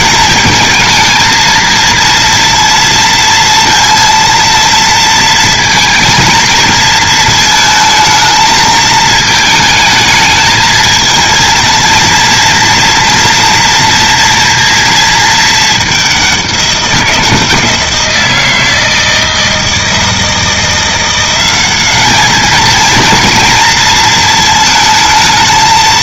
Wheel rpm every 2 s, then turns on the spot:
220, 230, 230, 230, 220, 220, 230, 230, 190, 160, 170, 220, 220.
none